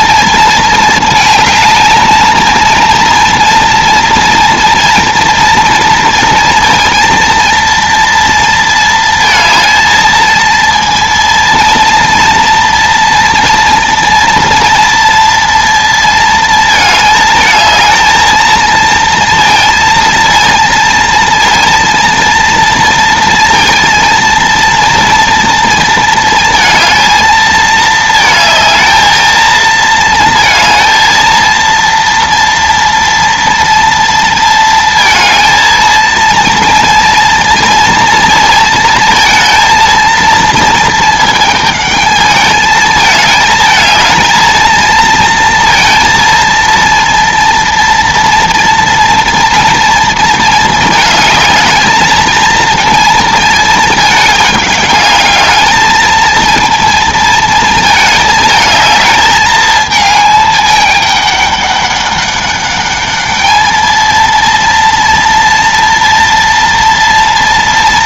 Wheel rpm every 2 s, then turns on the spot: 220, 230, 230, 230, 230, 230, 230, 230, 220, 220, 230, 230, 230, 230, 220, 220, 230, 230, 230, 230, 230, 210, 220, 230, 230, 230, 230, 210, 220, 220, 220, 200, 230, 230.
none